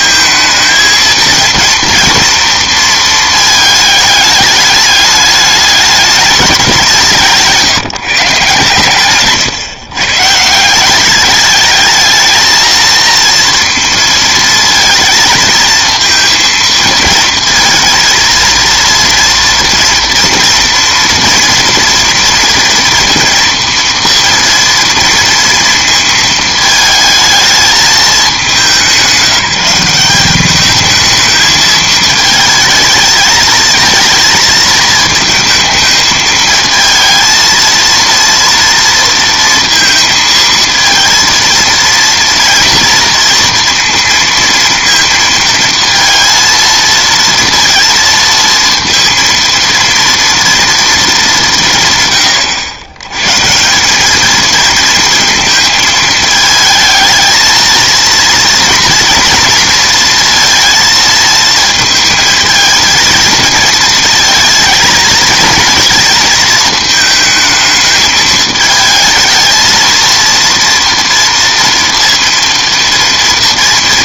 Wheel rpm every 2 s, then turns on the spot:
220, 230, 210, 200, 120, 170, 230, 230, 230, 230, 230, 230, 230, 220, 200, 210, 220, 220, 220, 230, 230, 230, 230, 230, 230, 230, 110, 220, 220, 230, 230, 220, 230, 220, 220, 230, 230.
none